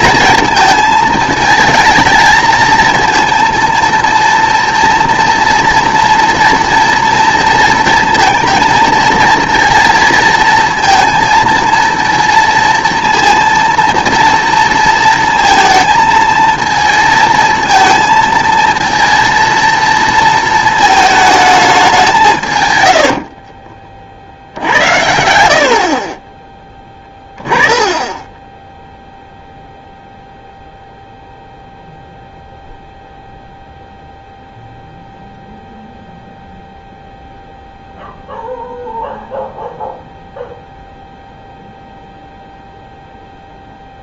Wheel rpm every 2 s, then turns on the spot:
220, 220, 230, 230, 230, 230, 230, 230, 230, 230, 220, 120, 70, 20, 10, 0, 0, 0, 0, 0, 0, 0.
none